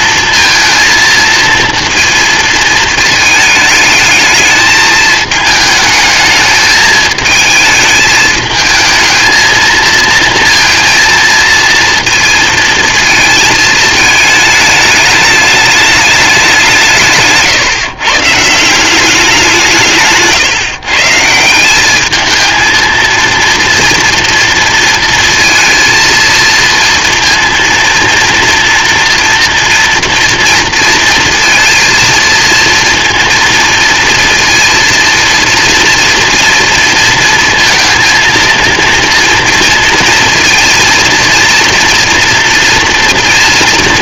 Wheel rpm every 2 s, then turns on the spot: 230, 220, 220, 220, 220, 230, 230, 210, 180, 160, 140, 220, 230, 230, 240, 230, 230, 230, 240, 230, 230, 230.
none